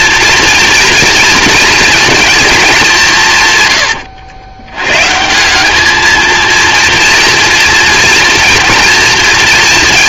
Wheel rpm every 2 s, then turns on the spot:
230, 220, 100, 230, 230.
none